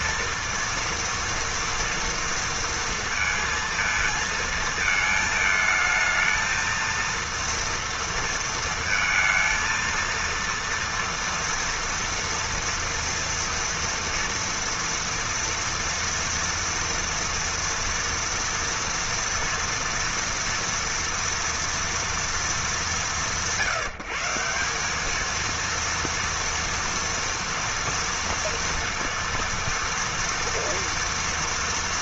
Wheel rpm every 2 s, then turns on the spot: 230, 230, 220, 230, 230, 230, 230, 230, 230, 240, 230, 170, 200, 230, 230, 230.
none